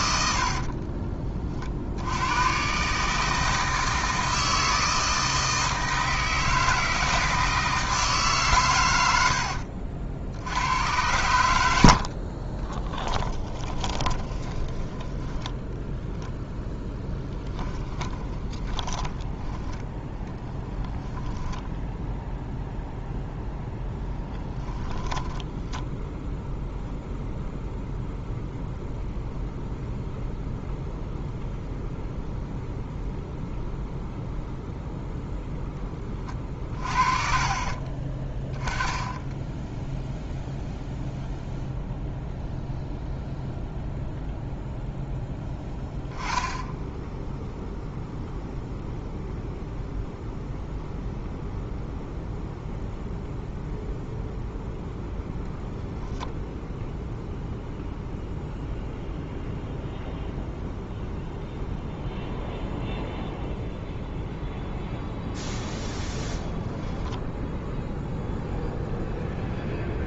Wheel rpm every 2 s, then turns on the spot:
40, 140, 160, 160, 100, 90, 10, 10, 0, 10, 10, 0, 20, 0, 0, 0, 0, 0, 30, 10, 0, 0, 0, 10, 0, 0, 0, 0, 0, 0, 0, 0, 0, 20, 0.
0-2 12-16 18-22 24-26 38-40 66-68